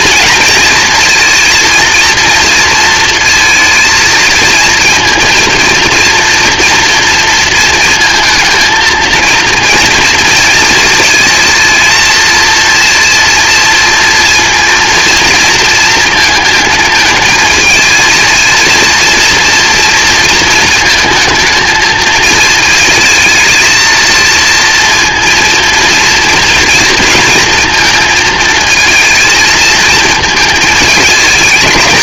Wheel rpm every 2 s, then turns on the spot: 230, 230, 230, 230, 230, 230, 230, 230, 220, 230, 220, 220, 230, 230, 230, 220.
none